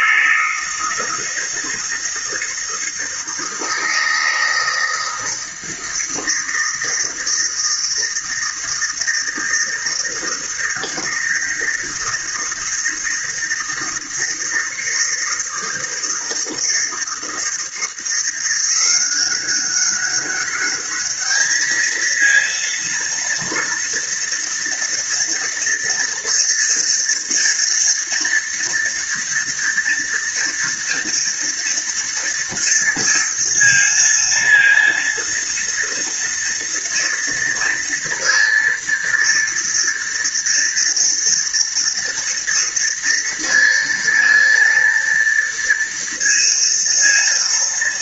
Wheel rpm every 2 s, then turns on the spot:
160, 160, 160, 160, 160, 160, 160, 160, 160, 180, 200, 230, 230, 230, 230, 230, 230, 230, 230, 230, 230, 230, 230, 230.
none